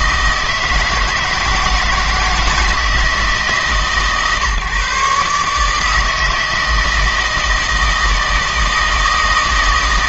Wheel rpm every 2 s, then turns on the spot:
160, 160, 150, 160, 160.
none